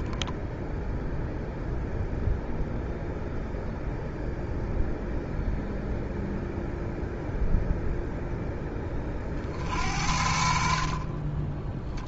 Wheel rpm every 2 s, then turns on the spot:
0, 0, 0, 0, 20, 50.
none